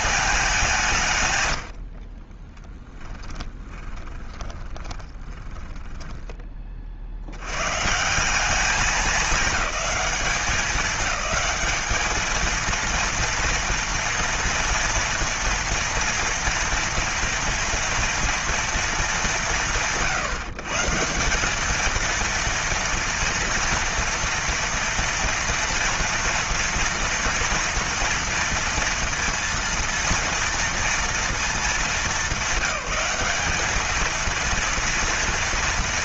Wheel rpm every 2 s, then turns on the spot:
170, 10, 20, 40, 190, 190, 230, 230, 230, 190, 170, 230, 240, 230, 230, 230, 210, 230.
2-6